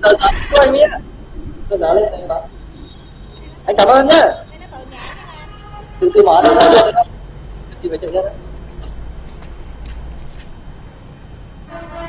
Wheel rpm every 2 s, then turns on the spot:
10, 0, 10, 0, 0, 0.
none